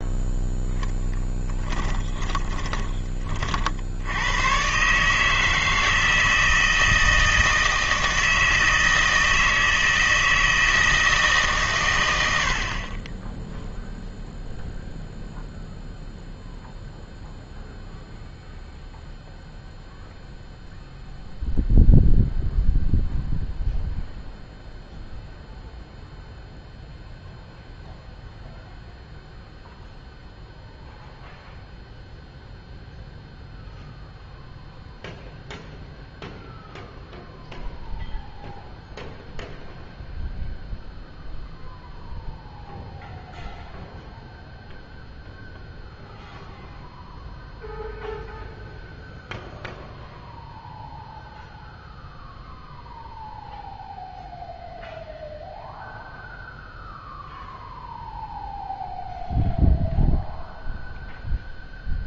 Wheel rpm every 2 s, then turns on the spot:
0, 20, 110, 160, 160, 160, 70, 0, 0, 0, 0, 0, 0, 0, 0, 0, 0, 0, 0, 0, 0, 0, 0, 0, 0, 0, 0, 0, 0, 0, 0.
2-4